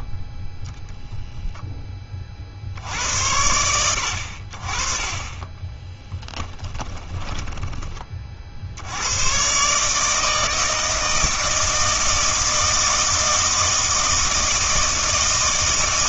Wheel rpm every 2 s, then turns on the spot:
0, 60, 50, 10, 60, 160, 160, 160.
6-8